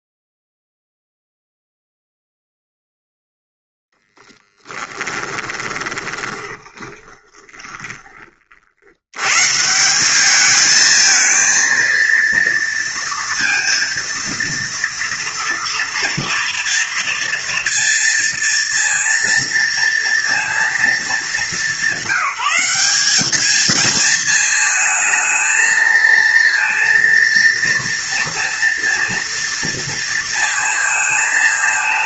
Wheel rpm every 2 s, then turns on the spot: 0, 0, 10, 20, 70, 220, 230, 230, 230, 230, 230, 200, 230, 230, 230, 230.
4-8